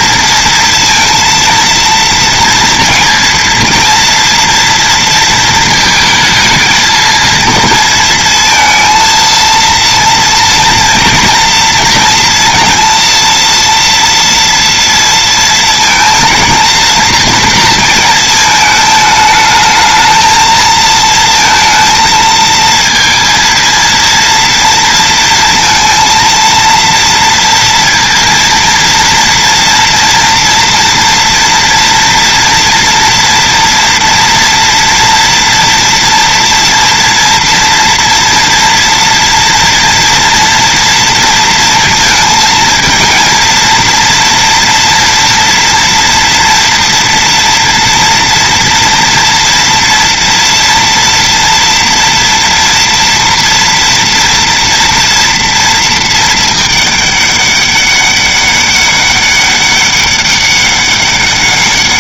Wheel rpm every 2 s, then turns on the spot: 230, 230, 230, 220, 230, 230, 230, 230, 230, 220, 230, 230, 230, 230, 230, 240, 230, 230, 230, 230, 230, 230, 230, 230, 230, 230, 230, 230, 210, 200, 200.
none